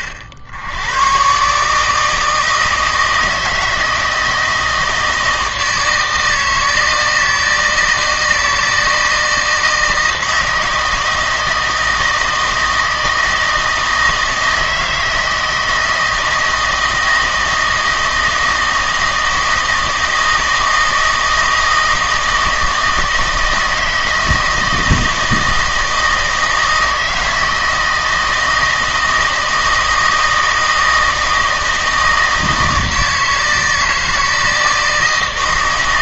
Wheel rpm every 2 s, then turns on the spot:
70, 160, 160, 160, 160, 160, 160, 160, 160, 160, 160, 160, 160, 160, 160, 160, 160, 160.
none